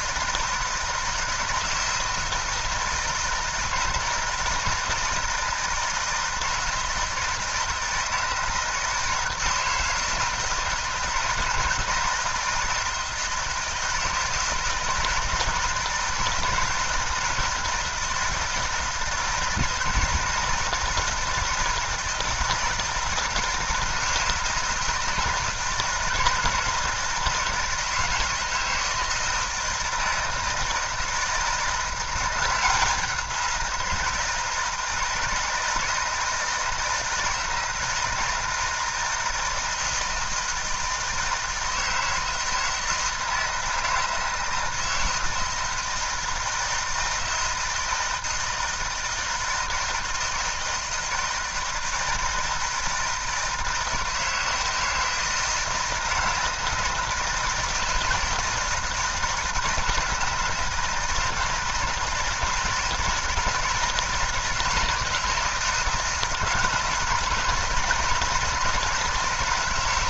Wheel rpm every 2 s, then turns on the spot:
160, 160, 160, 160, 160, 160, 160, 160, 160, 170, 160, 160, 160, 160, 160, 160, 180, 160, 160, 160, 160, 160, 160, 160, 160, 160, 160, 160, 160, 160, 160, 160, 160, 160, 170.
none